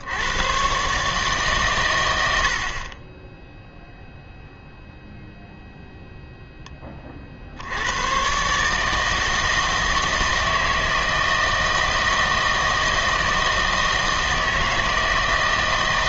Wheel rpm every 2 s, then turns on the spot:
120, 60, 0, 10, 140, 160, 160, 160.
none